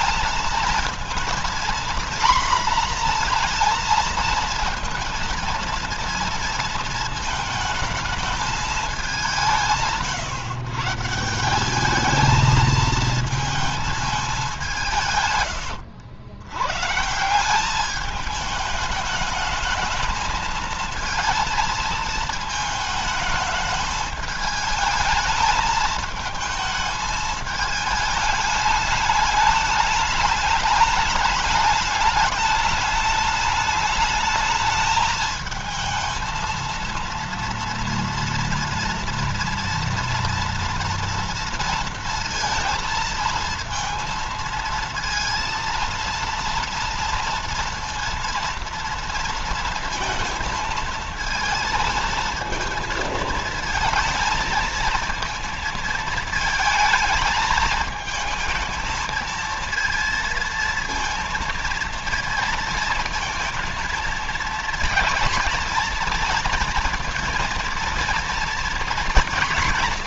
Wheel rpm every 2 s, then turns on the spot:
230, 240, 230, 220, 210, 130, 220, 190, 110, 210, 220, 220, 220, 220, 210, 210, 210, 220, 230, 230, 240, 230, 230, 230, 230, 220, 230, 230, 230, 220, 230, 230, 230, 230, 230.
none